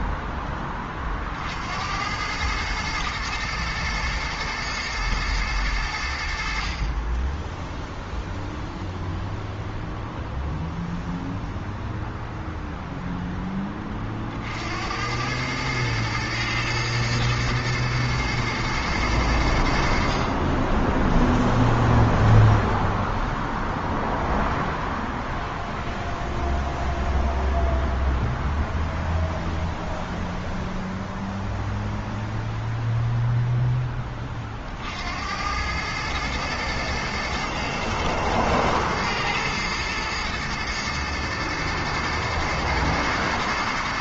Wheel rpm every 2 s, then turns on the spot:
30, 110, 110, 40, 0, 0, 0, 80, 110, 110, 20, 0, 0, 0, 0, 0, 0, 60, 120, 110, 110, 110.
none